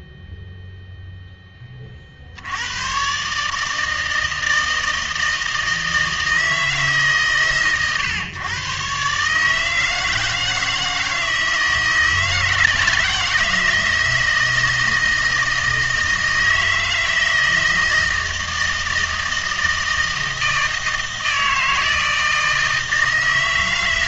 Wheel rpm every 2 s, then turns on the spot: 0, 90, 160, 160, 120, 160, 160, 160, 160, 160, 160, 160.
none